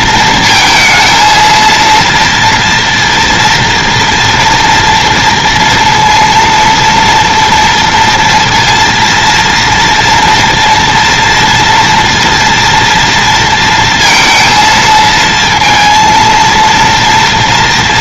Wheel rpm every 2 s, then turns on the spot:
230, 240, 230, 230, 230, 230, 230, 230, 230.
none